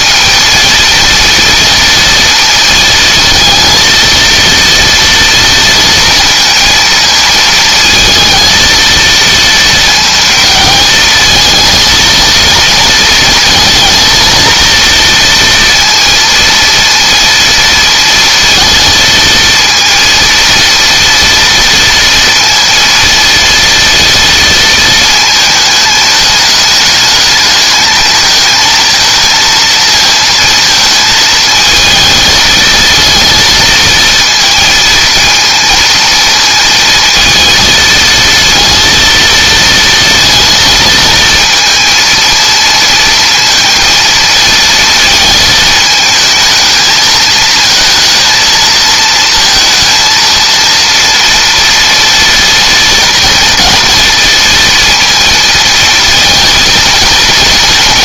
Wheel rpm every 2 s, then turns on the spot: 230, 220, 230, 230, 230, 220, 230, 230, 230, 230, 230, 230, 230, 210, 220, 230, 220, 230, 230, 230, 230, 230, 230, 220, 230, 230, 230, 230, 230.
none